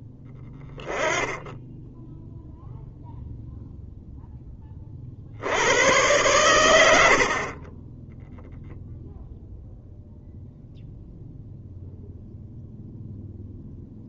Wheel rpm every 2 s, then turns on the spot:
10, 0, 30, 60, 0, 0, 0.
none